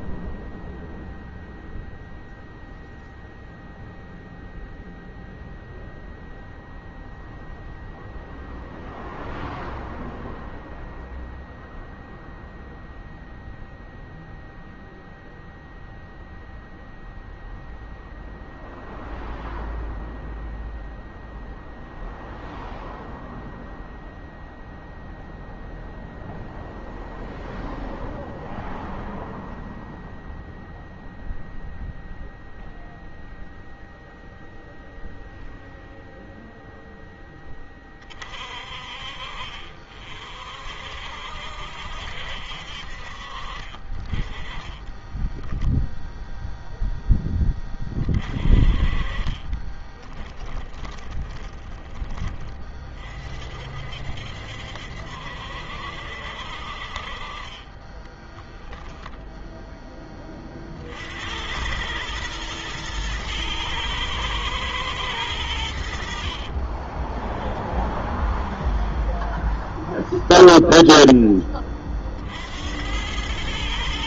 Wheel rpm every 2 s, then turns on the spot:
0, 0, 0, 0, 0, 0, 0, 0, 0, 0, 0, 0, 0, 0, 0, 0, 0, 0, 40, 50, 60, 30, 0, 30, 20, 20, 60, 60, 10, 20, 100, 110, 60, 0, 0, 20, 110.
42-44 48-50 56-58